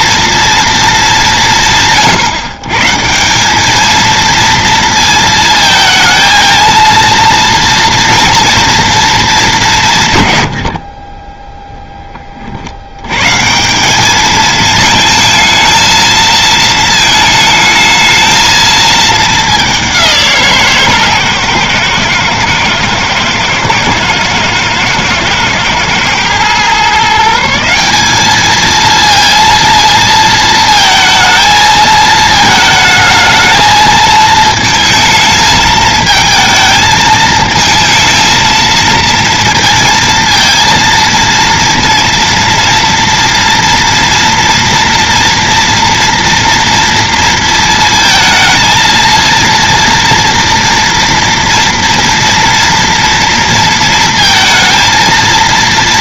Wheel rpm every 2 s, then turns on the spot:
230, 140, 230, 230, 230, 80, 60, 220, 220, 220, 150, 110, 120, 120, 220, 220, 220, 220, 220, 230, 230, 230, 230, 230, 230, 230, 230, 230.
10-12